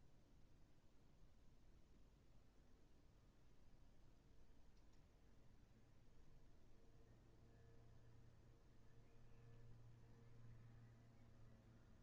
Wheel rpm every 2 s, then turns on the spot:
0, 0, 0, 0, 0, 0.
none